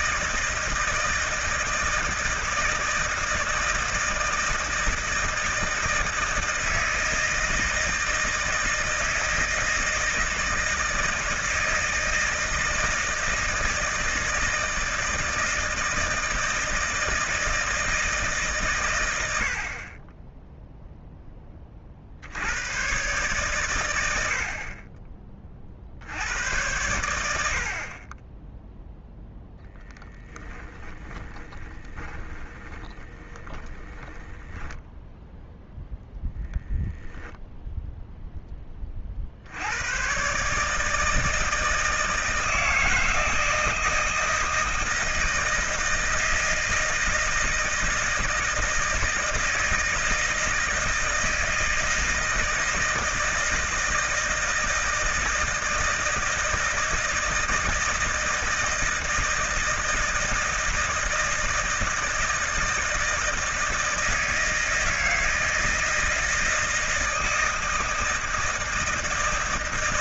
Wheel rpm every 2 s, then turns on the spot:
160, 160, 160, 160, 160, 160, 160, 160, 160, 120, 0, 100, 50, 90, 10, 10, 20, 10, 10, 20, 150, 160, 160, 160, 160, 160, 160, 160, 160, 160, 160, 160, 160, 160, 160.
30-38